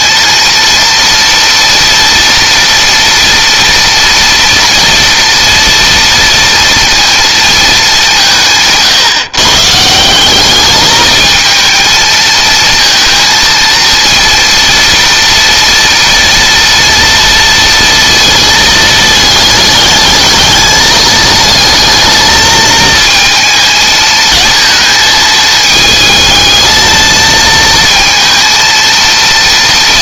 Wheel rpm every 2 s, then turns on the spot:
230, 230, 230, 230, 150, 210, 230, 230, 230, 220, 220, 220, 220, 220, 230.
none